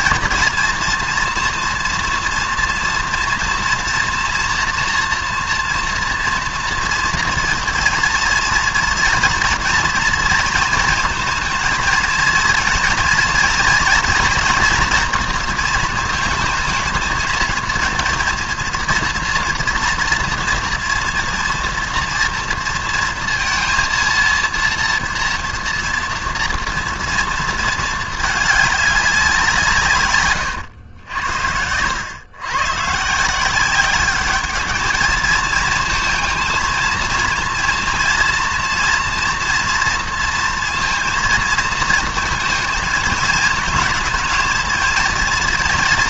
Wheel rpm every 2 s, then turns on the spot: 230, 240, 240, 230, 230, 230, 230, 240, 220, 230, 230, 230, 230, 230, 200, 90, 140, 220, 220, 230, 230, 220, 230.
none